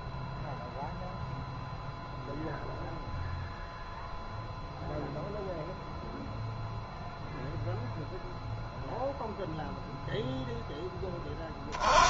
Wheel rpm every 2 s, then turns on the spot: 0, 0, 0, 0, 0, 10.
none